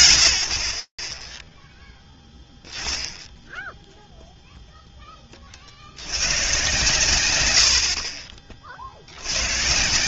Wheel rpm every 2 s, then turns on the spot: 100, 10, 0, 120, 70.
none